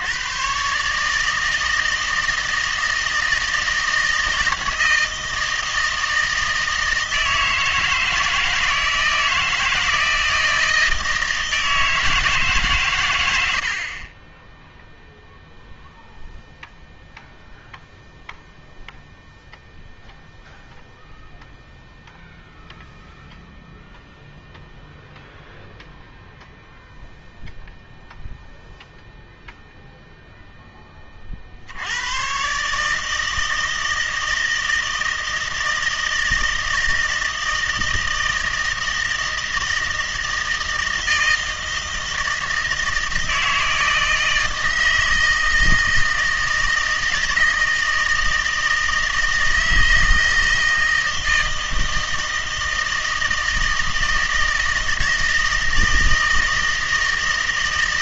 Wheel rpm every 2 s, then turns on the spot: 140, 160, 160, 160, 160, 160, 140, 0, 0, 0, 0, 0, 0, 0, 0, 10, 150, 160, 160, 160, 160, 160, 160, 160, 160, 160, 160, 160, 160.
none